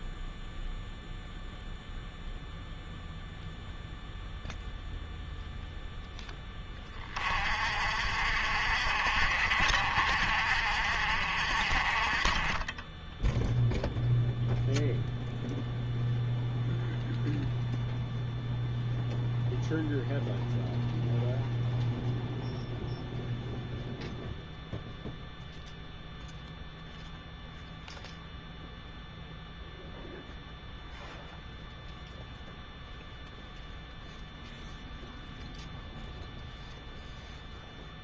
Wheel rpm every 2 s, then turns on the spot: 0, 0, 0, 10, 50, 60, 20, 0, 0, 0, 0, 0, 0, 0, 0, 0, 0, 0, 0.
none